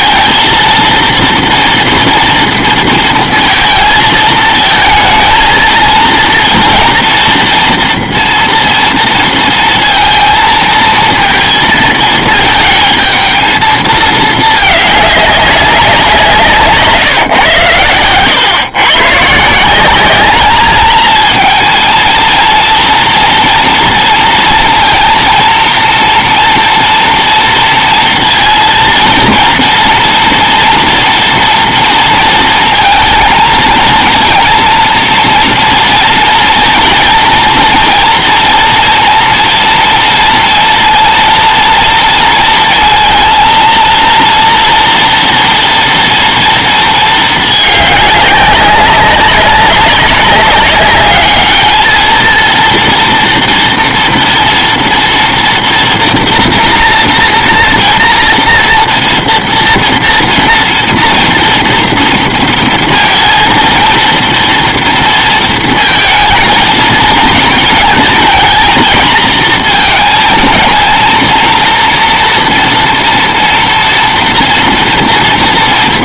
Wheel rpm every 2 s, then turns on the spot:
230, 230, 220, 230, 230, 230, 220, 220, 160, 110, 210, 230, 230, 230, 230, 240, 220, 230, 230, 230, 230, 230, 240, 230, 200, 200, 230, 230, 230, 230, 230, 230, 230, 220, 220, 220, 230, 230.
none